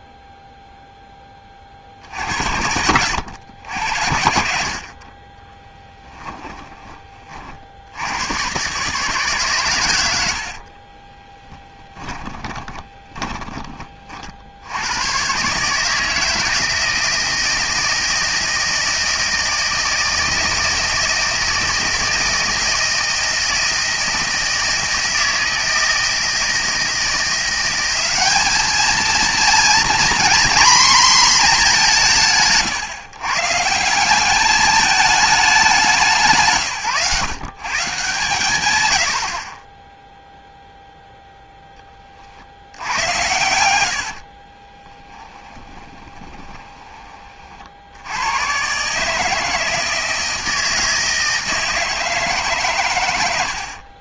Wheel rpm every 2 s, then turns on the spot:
20, 100, 30, 40, 140, 20, 20, 120, 160, 160, 160, 160, 160, 170, 220, 240, 140, 210, 140, 70, 0, 110, 20, 20, 120, 160, 130.
10-14 42-48